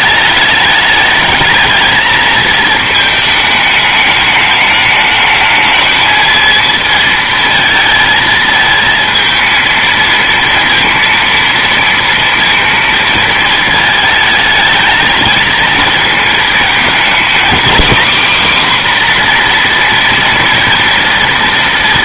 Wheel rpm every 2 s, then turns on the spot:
210, 220, 210, 220, 220, 230, 230, 220, 230, 260, 240.
none